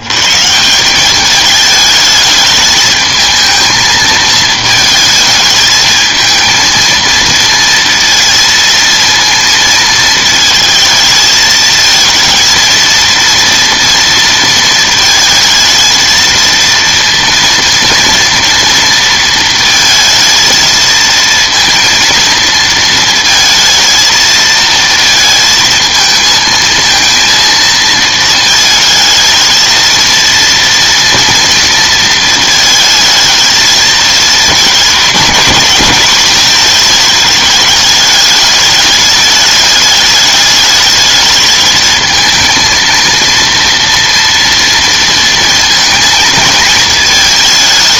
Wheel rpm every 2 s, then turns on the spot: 140, 220, 220, 220, 230, 220, 230, 230, 230, 230, 220, 230, 230, 220, 220, 230, 220, 210, 220, 210, 210, 230, 230, 220.
none